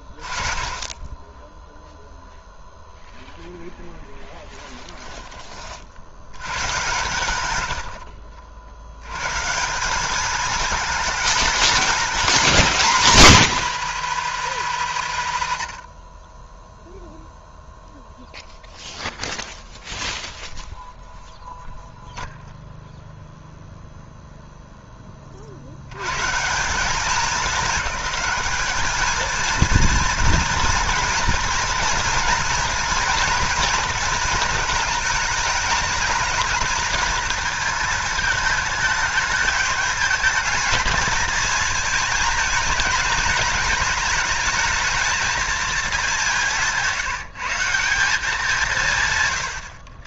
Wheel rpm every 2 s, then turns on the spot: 10, 0, 10, 110, 80, 220, 210, 140, 10, 0, 0, 0, 0, 180, 220, 240, 230, 220, 220, 210, 220, 220, 220, 170, 160.
4-6